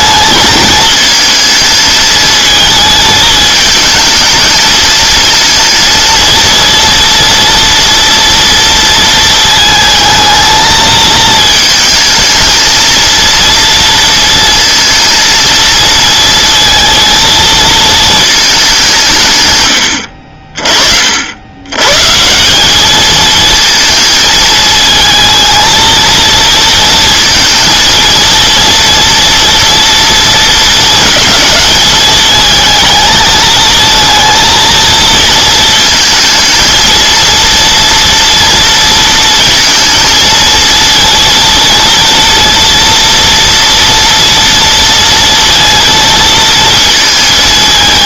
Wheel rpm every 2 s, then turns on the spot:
220, 220, 220, 230, 230, 220, 220, 230, 230, 210, 50, 190, 220, 230, 230, 230, 220, 230, 230, 230, 230, 230, 230, 230.
none